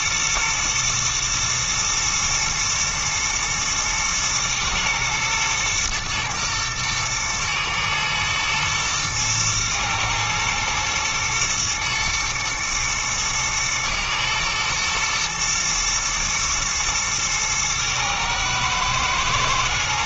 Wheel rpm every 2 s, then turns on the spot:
110, 120, 110, 120, 120, 110, 110, 120, 120, 110.
none